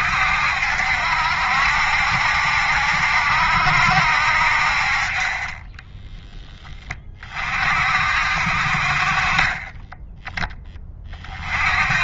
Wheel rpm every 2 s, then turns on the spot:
70, 70, 60, 10, 50, 20.
none